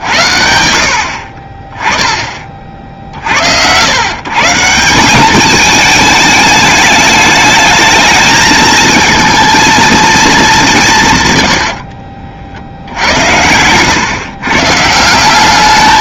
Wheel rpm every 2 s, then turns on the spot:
60, 50, 160, 210, 220, 180, 70, 140.
none